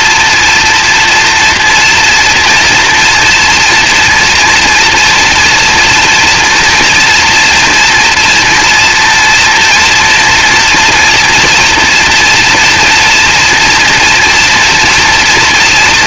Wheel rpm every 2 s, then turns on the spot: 230, 240, 240, 230, 230, 230, 230, 230.
none